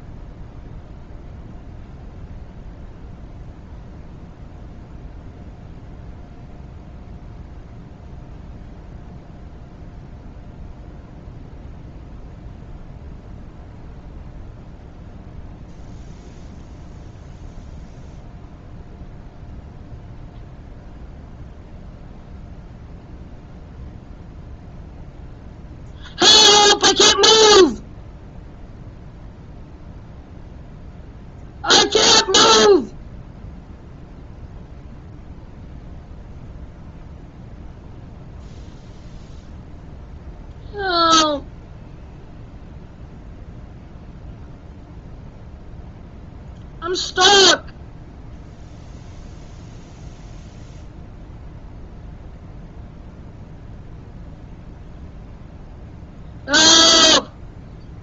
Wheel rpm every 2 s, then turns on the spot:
0, 0, 0, 0, 0, 0, 0, 0, 0, 0, 0, 0, 0, 0, 0, 0, 0, 0, 0, 0, 0, 0, 0, 0, 0, 0, 0, 0, 0.
none